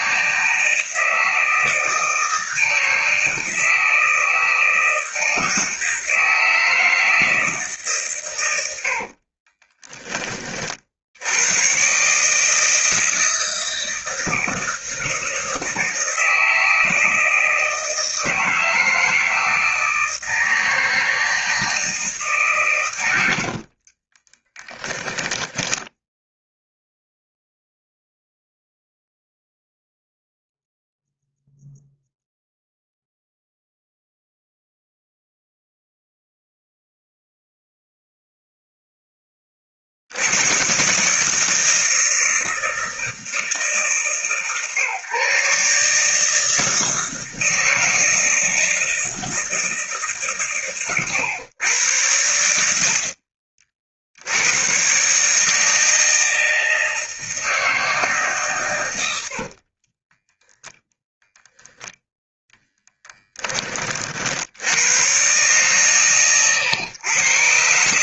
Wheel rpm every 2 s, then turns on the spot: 160, 160, 160, 160, 70, 70, 160, 170, 160, 160, 160, 100, 10, 0, 0, 0, 0, 0, 0, 0, 130, 160, 140, 160, 160, 120, 70, 130, 160, 100, 0, 10, 110, 120.
8-10 24-26 62-64